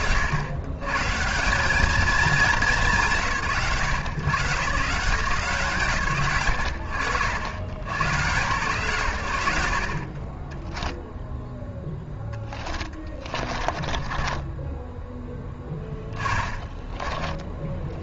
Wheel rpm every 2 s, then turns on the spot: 100, 160, 160, 70, 110, 0, 30, 10, 10.
12-18